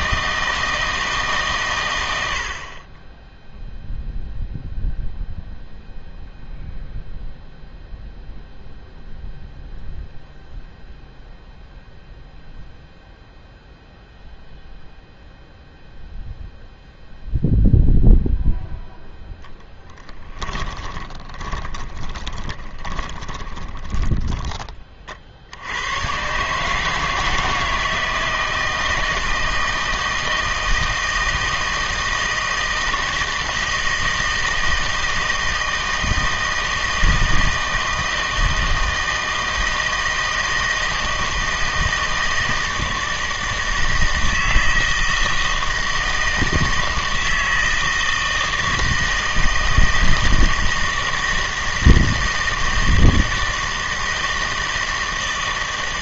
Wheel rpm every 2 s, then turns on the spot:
160, 50, 0, 0, 0, 0, 0, 0, 0, 0, 20, 20, 30, 150, 160, 160, 160, 160, 160, 160, 160, 160, 160, 160, 160, 160, 160, 160.
20-24